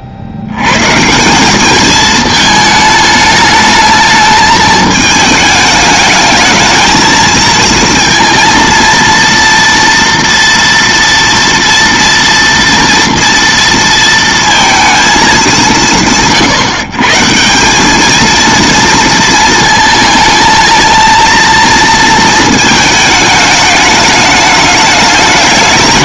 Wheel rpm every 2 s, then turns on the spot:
90, 220, 220, 220, 230, 230, 230, 230, 110, 230, 220, 220, 210.
none